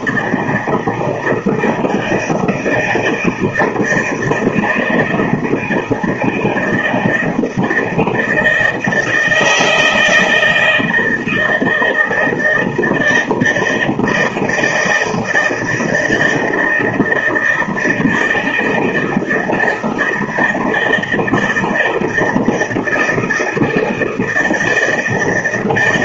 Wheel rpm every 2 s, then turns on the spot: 160, 160, 160, 160, 160, 170, 160, 160, 160, 160, 160, 160, 160.
none